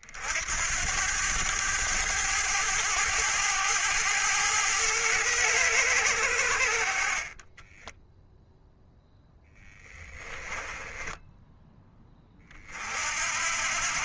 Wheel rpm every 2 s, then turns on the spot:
90, 110, 110, 50, 0, 10, 60.
10-12